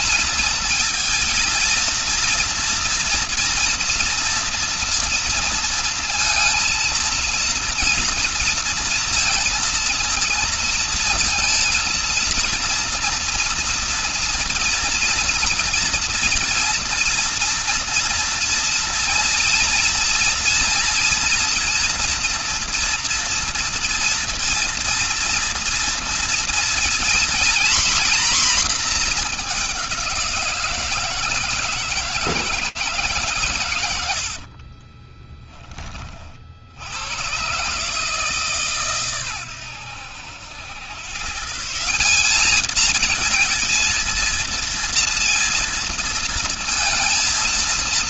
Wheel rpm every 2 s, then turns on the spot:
230, 230, 230, 230, 230, 230, 230, 230, 230, 230, 230, 230, 230, 230, 240, 170, 160, 30, 70, 140, 100, 210, 230, 220.
34-36